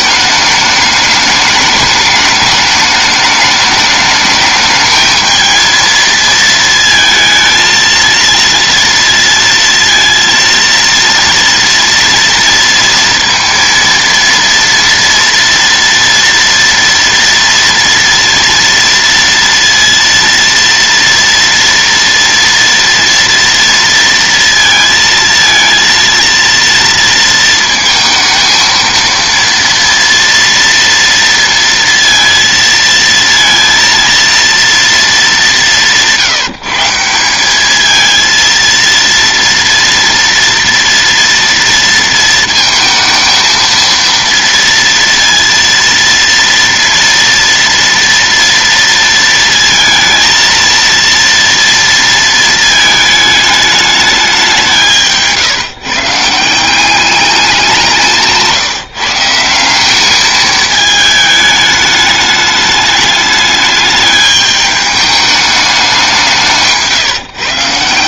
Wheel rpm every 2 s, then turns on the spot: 210, 210, 220, 230, 230, 230, 230, 230, 240, 230, 230, 230, 230, 230, 230, 230, 230, 230, 160, 230, 230, 230, 230, 230, 230, 230, 220, 160, 180, 160, 220, 210, 210, 150.
66-68